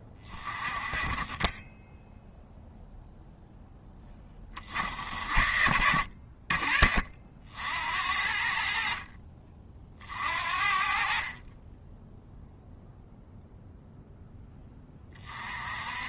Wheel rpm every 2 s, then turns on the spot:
20, 0, 50, 50, 50, 50, 0, 10.
none